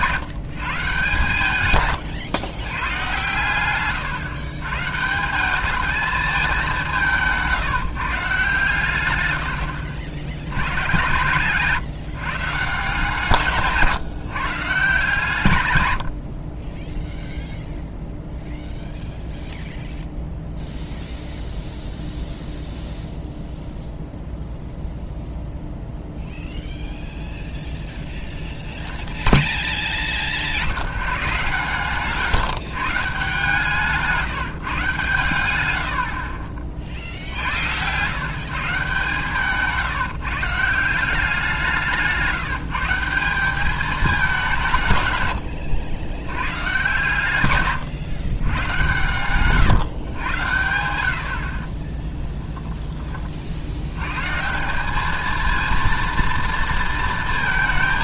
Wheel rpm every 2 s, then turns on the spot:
150, 120, 140, 180, 120, 100, 150, 140, 10, 0, 0, 0, 0, 0, 0, 80, 160, 150, 40, 150, 170, 170, 170, 120, 110, 80, 20, 180, 230.
none